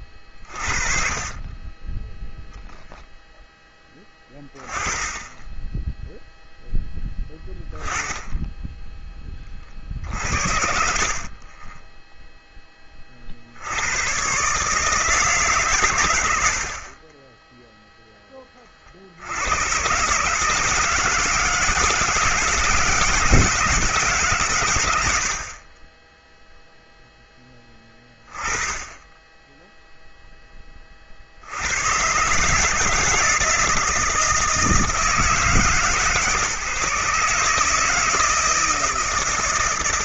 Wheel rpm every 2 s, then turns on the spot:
40, 0, 10, 0, 0, 60, 10, 150, 70, 20, 160, 160, 100, 0, 20, 20, 150, 160, 150, 160.
10-12